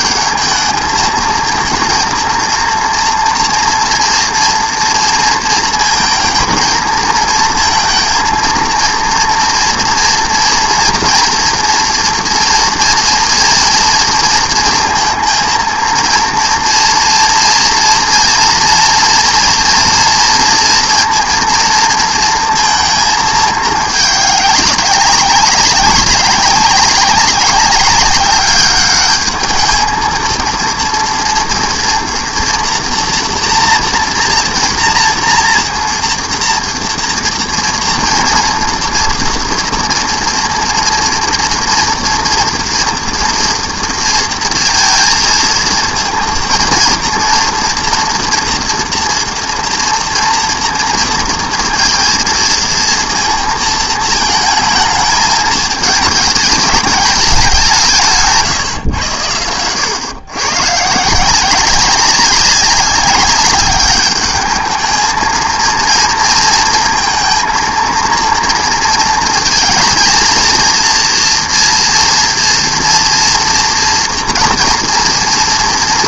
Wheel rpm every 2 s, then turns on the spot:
220, 230, 230, 230, 230, 240, 230, 230, 230, 230, 230, 220, 200, 200, 210, 230, 240, 230, 230, 230, 230, 230, 230, 230, 230, 230, 230, 220, 210, 110, 150, 200, 220, 230, 230, 230, 230, 230.
none